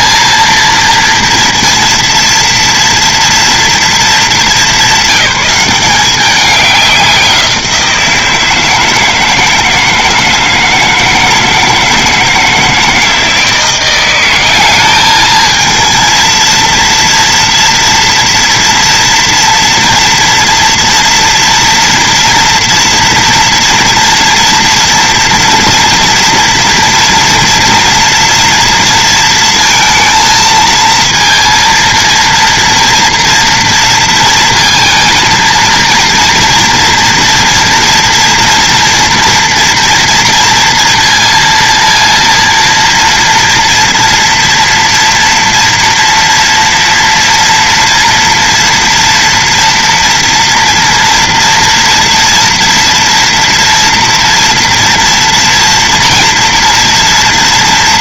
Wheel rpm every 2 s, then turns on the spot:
230, 230, 190, 190, 160, 160, 160, 210, 230, 230, 230, 230, 240, 230, 230, 230, 230, 230, 230, 230, 230, 230, 230, 230, 230, 230, 230, 230, 230.
none